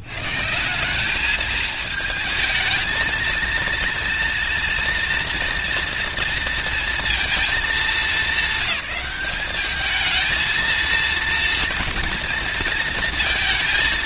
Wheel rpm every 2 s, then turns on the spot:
90, 220, 230, 230, 210, 230, 230.
none